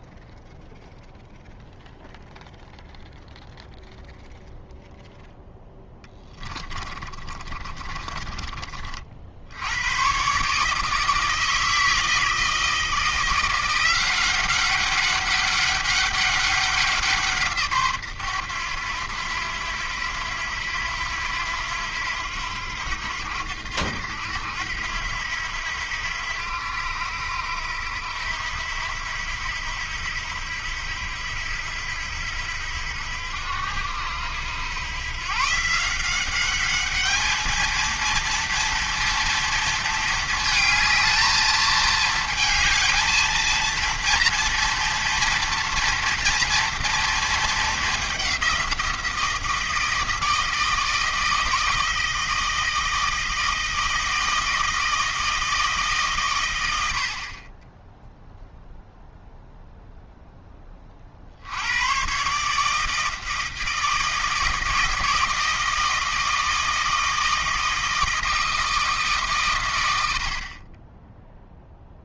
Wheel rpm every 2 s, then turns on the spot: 0, 0, 0, 30, 40, 150, 160, 190, 190, 100, 90, 90, 80, 90, 80, 80, 80, 100, 200, 230, 220, 220, 230, 240, 180, 160, 160, 160, 100, 0, 20, 150, 160, 160, 160, 40.
6-8